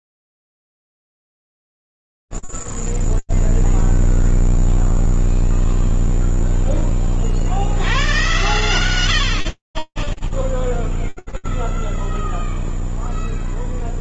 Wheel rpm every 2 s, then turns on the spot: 0, 0, 0, 0, 110, 0, 0.
none